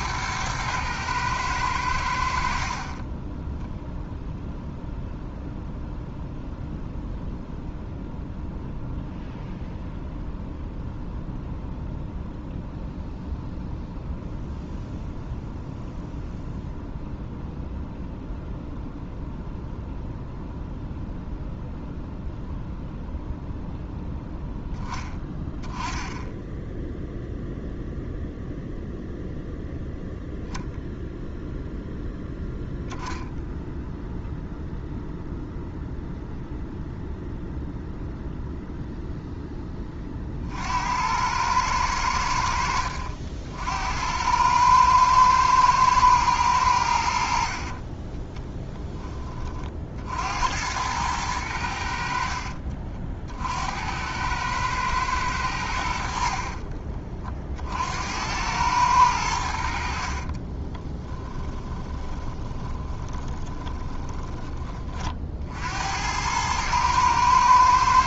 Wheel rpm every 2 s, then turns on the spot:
110, 50, 0, 0, 0, 0, 0, 0, 0, 0, 0, 0, 0, 10, 0, 0, 0, 0, 0, 0, 60, 70, 100, 90, 10, 80, 50, 110, 60, 100, 30, 20, 20, 110.
52-54 56-58 60-64